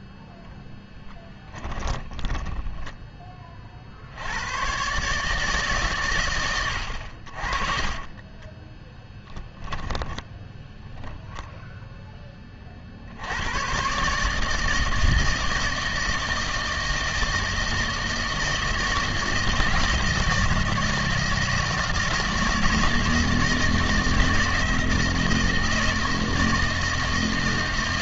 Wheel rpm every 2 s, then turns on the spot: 0, 10, 110, 80, 10, 10, 40, 160, 160, 160, 160, 160, 160, 160.
2-4 8-12